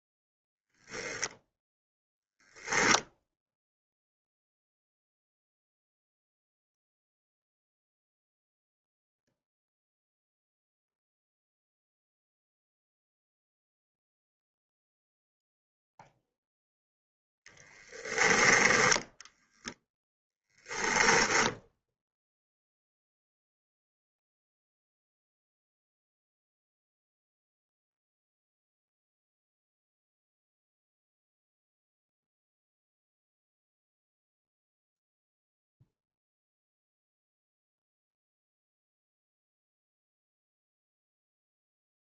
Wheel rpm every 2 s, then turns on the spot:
10, 0, 0, 0, 0, 0, 0, 0, 0, 10, 10, 0, 0, 0, 0, 0, 0, 0, 0, 0, 0.
none